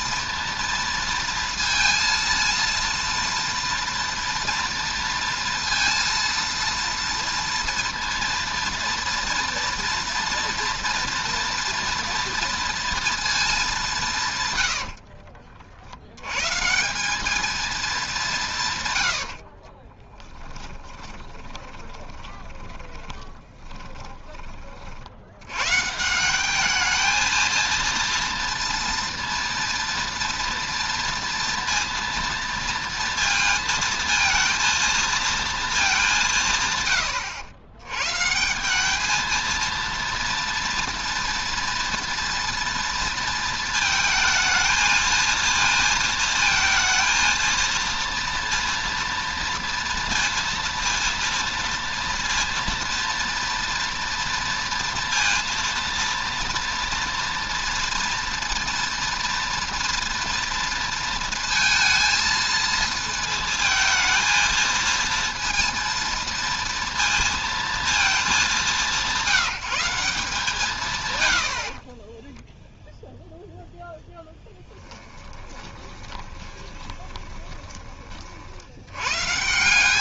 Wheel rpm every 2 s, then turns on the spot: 230, 230, 230, 230, 230, 230, 230, 100, 160, 140, 10, 20, 40, 210, 230, 230, 230, 230, 130, 190, 230, 230, 220, 220, 230, 230, 230, 230, 230, 230, 230, 230, 230, 230, 190, 150, 0, 10, 20, 70.
14-16 20-24 74-78